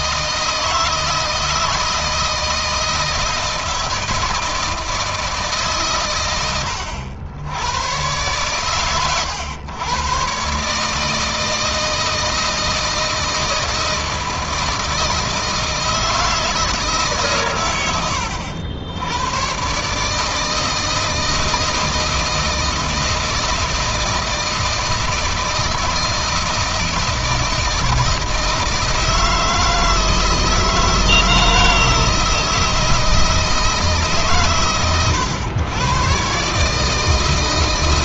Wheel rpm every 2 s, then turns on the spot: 160, 160, 160, 90, 110, 150, 160, 160, 150, 90, 160, 160, 160, 160, 160, 160, 160, 110, 150.
none